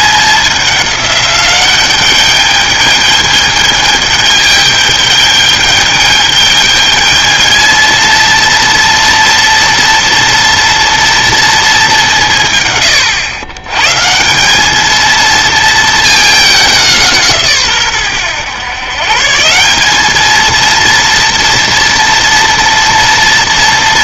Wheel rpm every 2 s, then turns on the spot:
200, 210, 210, 210, 230, 230, 130, 200, 190, 120, 230, 230.
none